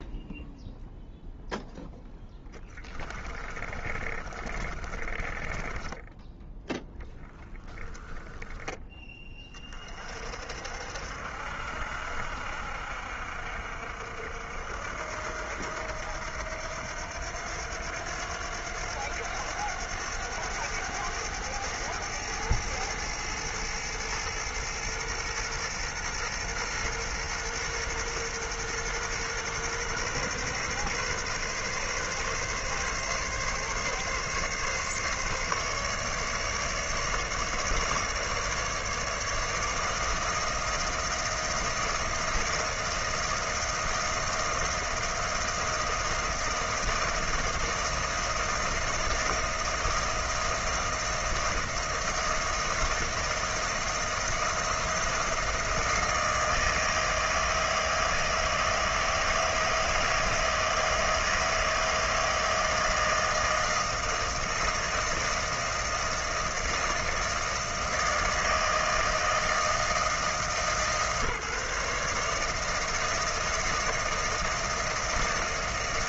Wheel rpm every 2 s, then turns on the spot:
0, 20, 30, 0, 10, 60, 60, 70, 80, 90, 100, 110, 120, 120, 120, 130, 140, 140, 150, 150, 160, 160, 160, 170, 160, 170, 160, 170, 160, 160, 160, 160, 160, 160, 160, 140, 160, 160.
2-6